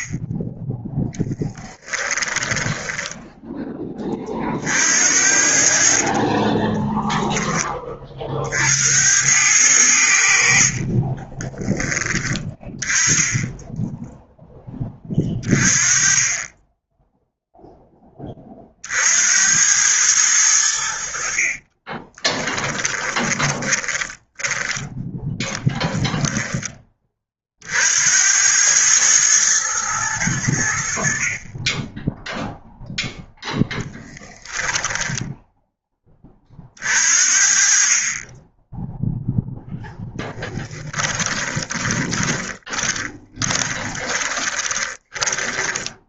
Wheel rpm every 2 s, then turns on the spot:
10, 10, 60, 10, 80, 40, 20, 20, 10, 60, 80, 20, 20, 20, 110, 70, 0, 10, 50, 10, 10, 20, 20.
2-4 10-12 22-24 34-36 40-46